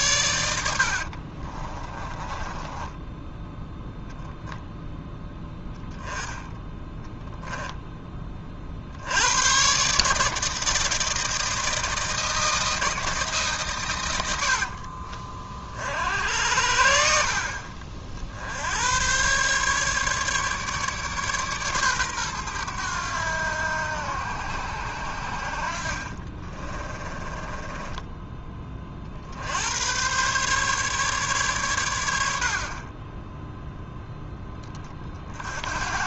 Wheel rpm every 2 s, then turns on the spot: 60, 10, 0, 10, 50, 160, 160, 60, 70, 80, 150, 110, 80, 20, 40, 140, 40, 40.
0-4 26-28